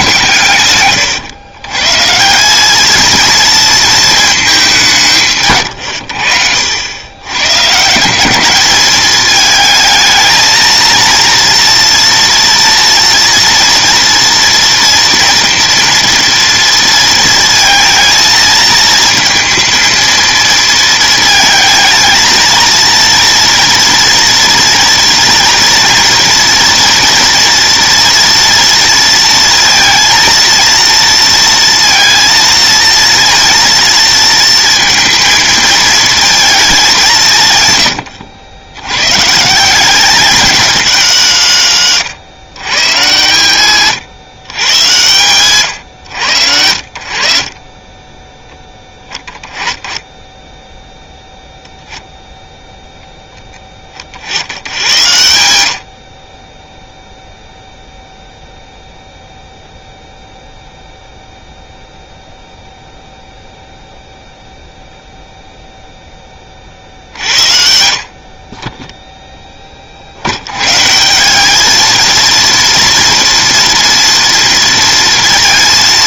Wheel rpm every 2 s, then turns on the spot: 120, 210, 200, 80, 200, 230, 230, 230, 230, 220, 230, 230, 240, 230, 230, 230, 230, 230, 200, 100, 210, 130, 120, 80, 20, 10, 0, 80, 0, 0, 0, 0, 0, 50, 20, 130, 230, 230.
0-2